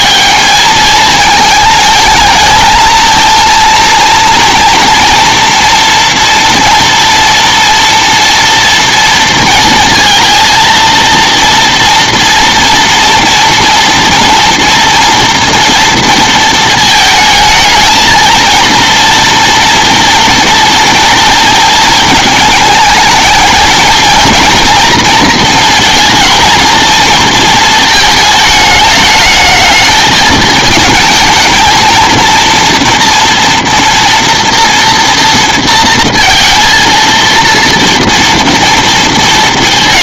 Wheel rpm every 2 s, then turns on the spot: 220, 220, 230, 240, 230, 230, 230, 230, 220, 230, 230, 220, 230, 220, 220, 220, 230, 230, 230, 230.
none